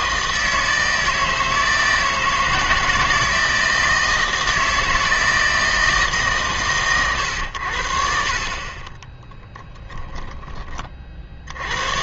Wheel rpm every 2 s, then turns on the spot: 160, 160, 160, 130, 30, 40.
8-12